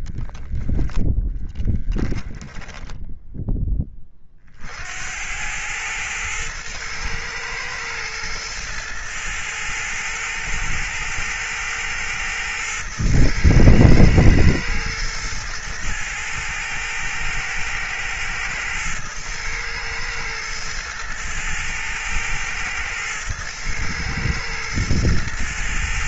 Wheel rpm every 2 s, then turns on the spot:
0, 10, 40, 110, 110, 110, 110, 110, 110, 110, 110, 110, 110.
2-4